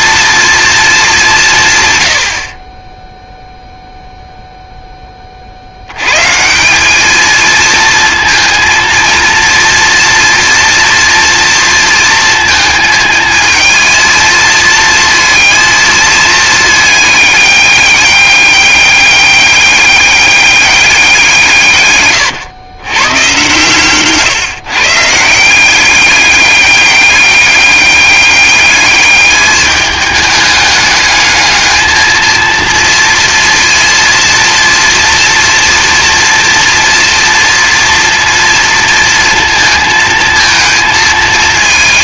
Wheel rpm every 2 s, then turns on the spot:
220, 20, 10, 190, 230, 230, 230, 230, 210, 200, 200, 120, 140, 200, 200, 210, 230, 230, 240, 230, 230.
none